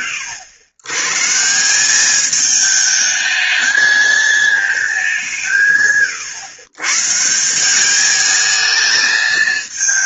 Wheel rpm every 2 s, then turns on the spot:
100, 210, 200, 140, 220.
none